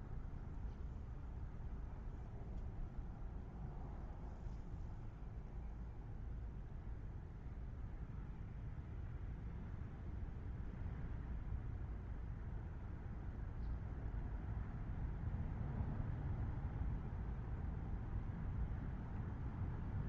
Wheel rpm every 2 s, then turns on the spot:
0, 0, 0, 0, 0, 0, 0, 0, 0, 0.
none